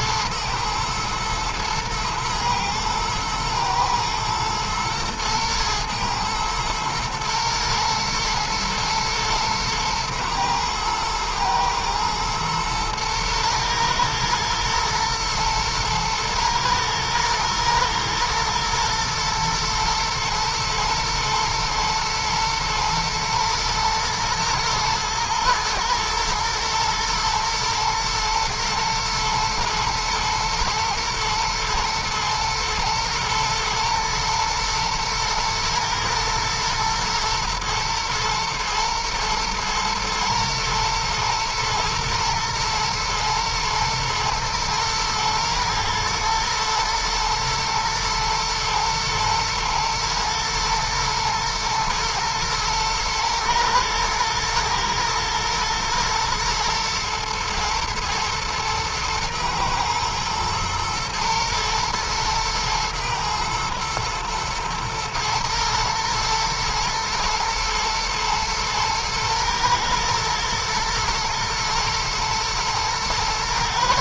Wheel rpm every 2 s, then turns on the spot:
110, 110, 120, 110, 120, 110, 110, 110, 110, 110, 110, 120, 120, 120, 110, 110, 120, 110, 120, 110, 110, 120, 110, 110, 120, 110, 110, 110, 110, 110, 120, 120, 120, 120, 120, 120, 120.
none